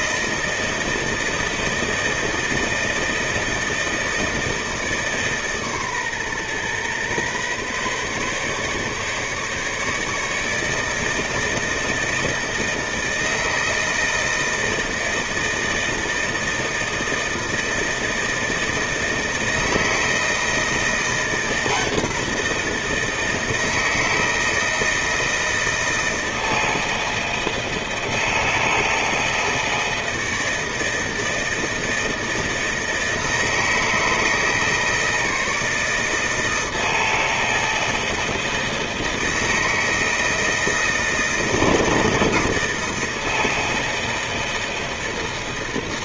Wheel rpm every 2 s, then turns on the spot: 160, 160, 160, 130, 140, 160, 160, 160, 160, 160, 170, 170, 160, 160, 160, 160, 160, 160, 160, 160, 160, 160, 160.
none